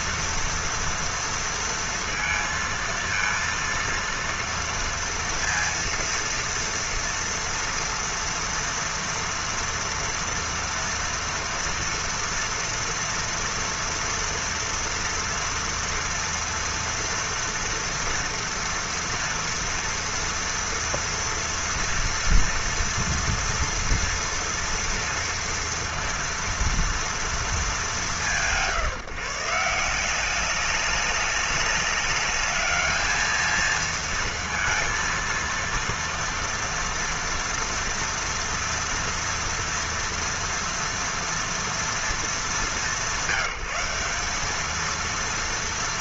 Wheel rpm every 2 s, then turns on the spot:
230, 230, 230, 230, 230, 230, 230, 230, 230, 230, 230, 230, 240, 230, 160, 190, 210, 230, 230, 240, 230, 210, 210.
none